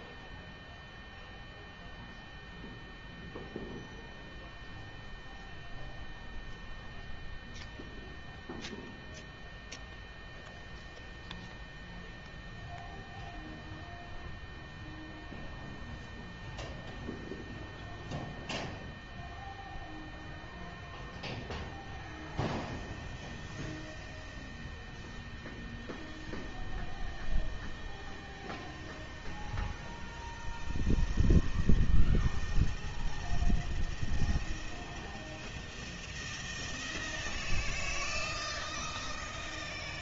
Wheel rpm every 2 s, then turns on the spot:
0, 0, 0, 0, 0, 0, 0, 0, 0, 0, 0, 0, 0, 0, 0, 0, 0, 0, 0, 0.
none